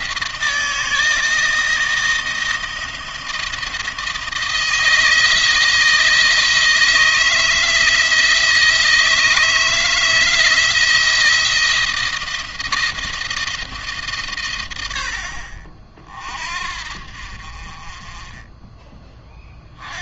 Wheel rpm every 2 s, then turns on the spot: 160, 160, 160, 160, 160, 160, 170, 100, 50, 20.
none